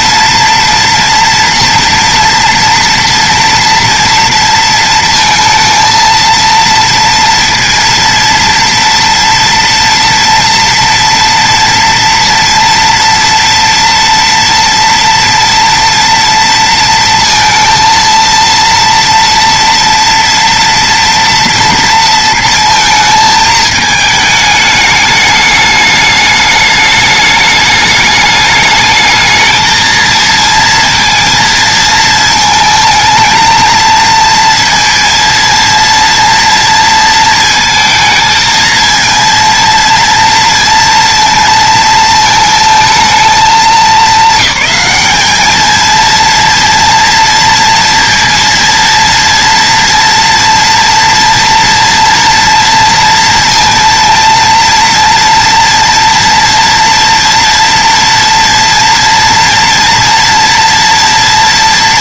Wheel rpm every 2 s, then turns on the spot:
230, 230, 230, 230, 230, 240, 230, 230, 230, 230, 230, 230, 210, 210, 220, 230, 220, 230, 230, 230, 230, 220, 210, 230, 230, 230, 230, 230, 230, 230, 230.
none